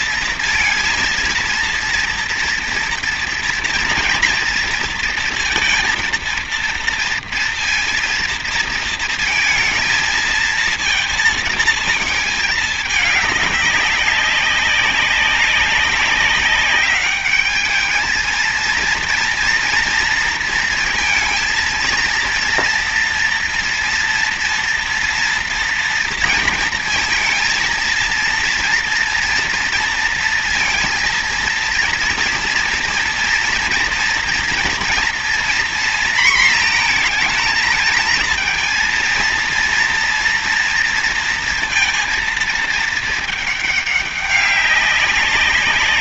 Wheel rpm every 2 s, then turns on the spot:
230, 230, 230, 230, 230, 220, 210, 190, 200, 220, 230, 240, 240, 230, 230, 230, 230, 240, 230, 230, 230, 220, 200.
none